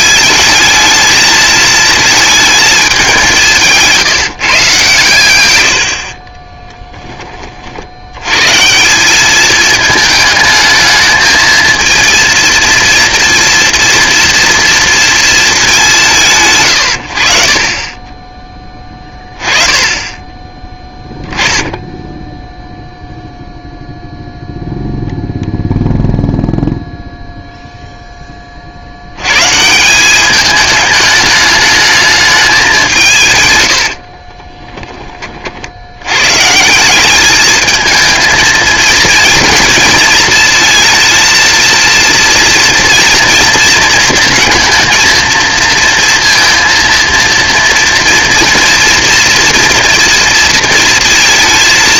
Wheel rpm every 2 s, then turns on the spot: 220, 220, 140, 30, 150, 220, 230, 230, 130, 20, 10, 0, 0, 0, 40, 210, 200, 20, 160, 230, 220, 230, 230, 230, 230, 230.
6-8 34-36